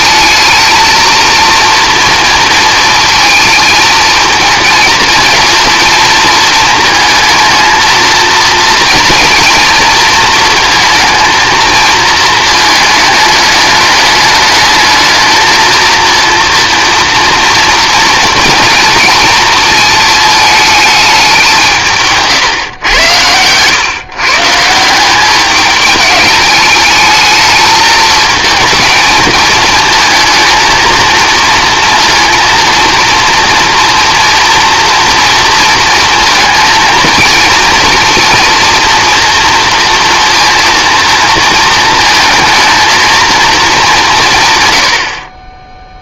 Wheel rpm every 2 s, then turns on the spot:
220, 230, 220, 230, 230, 230, 220, 210, 230, 230, 220, 140, 160, 210, 220, 230, 230, 230, 230, 230, 230, 230, 110.
none